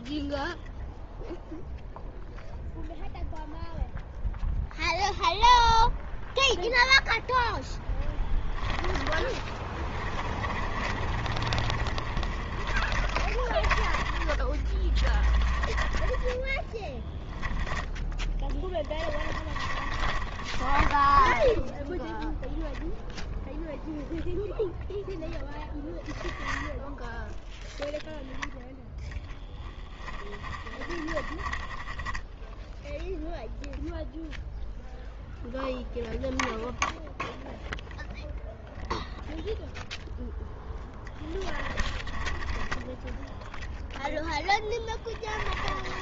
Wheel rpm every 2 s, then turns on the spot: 0, 0, 0, 0, 10, 30, 30, 30, 10, 10, 30, 0, 0, 0, 10, 20, 0, 0, 0, 0, 0, 20, 10.
10-22 28-30 44-46